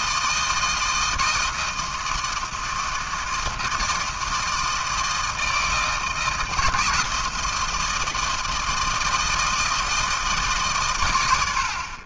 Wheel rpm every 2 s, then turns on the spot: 160, 160, 160, 160, 160, 140.
none